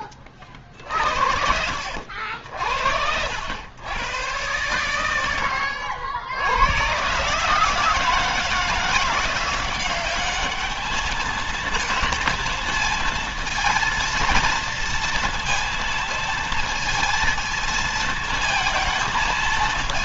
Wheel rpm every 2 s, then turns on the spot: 50, 60, 110, 110, 170, 210, 230, 230, 230, 220.
none